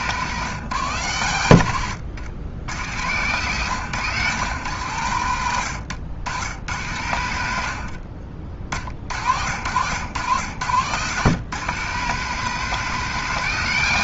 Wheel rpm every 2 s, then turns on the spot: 130, 100, 110, 100, 40, 110, 190.
none